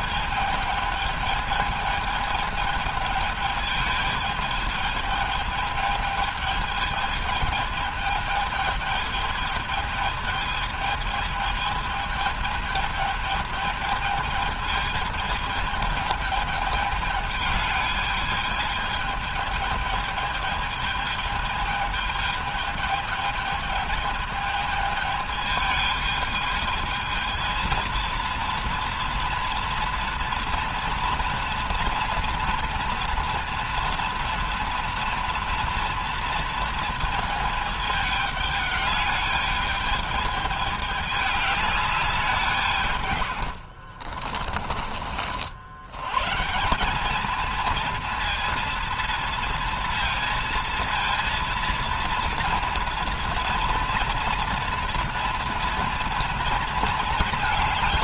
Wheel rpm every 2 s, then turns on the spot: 220, 220, 220, 220, 220, 220, 220, 220, 210, 220, 220, 220, 220, 220, 230, 230, 230, 230, 230, 210, 210, 150, 40, 190, 230, 230, 230, 240, 230.
none